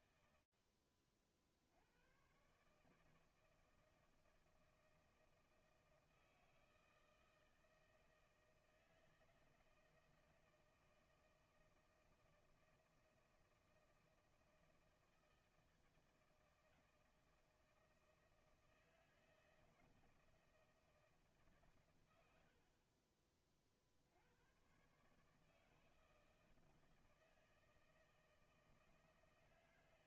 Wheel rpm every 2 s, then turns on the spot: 60, 160, 160, 160, 160, 160, 160, 160, 160, 160, 140, 40, 150, 160, 160.
none